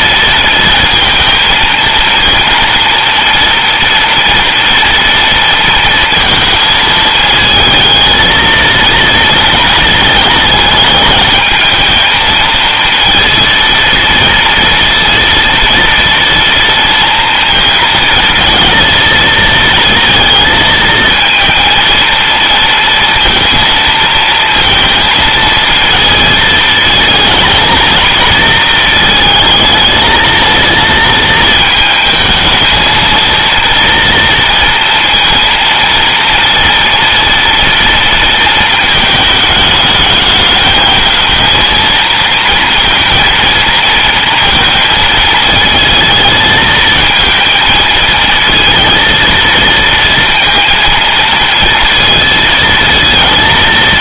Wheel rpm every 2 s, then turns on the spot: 230, 230, 230, 220, 230, 220, 230, 230, 230, 220, 230, 230, 230, 220, 220, 220, 220, 230, 230, 220, 220, 230, 220, 220, 230, 230, 230.
none